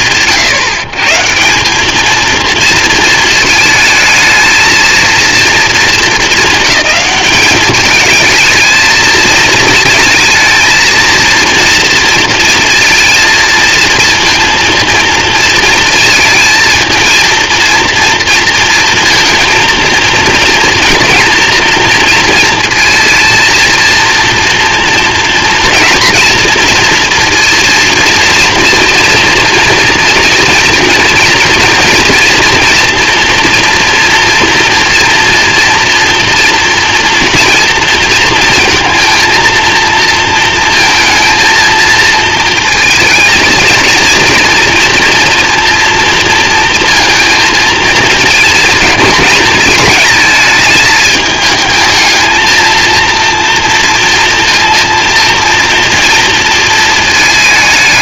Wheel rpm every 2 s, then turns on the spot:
130, 220, 220, 200, 220, 230, 230, 230, 230, 230, 240, 230, 230, 230, 230, 240, 240, 230, 230, 230, 230, 230, 230, 220, 220, 220, 230, 230, 220.
none